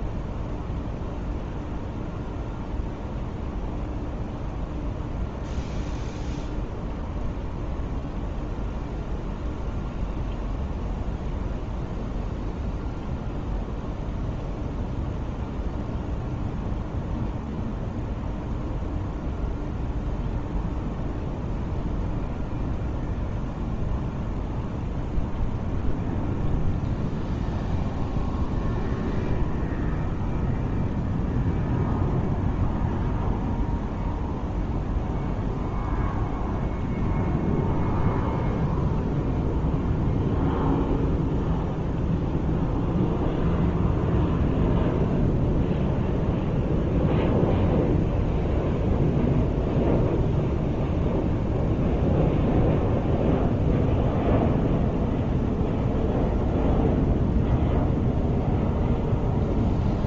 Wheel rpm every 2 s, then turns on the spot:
0, 0, 0, 0, 0, 0, 0, 0, 0, 0, 0, 0, 0, 0, 0, 0, 0, 0, 0, 0, 0, 0, 0, 0, 0, 0, 0, 0, 0, 0.
none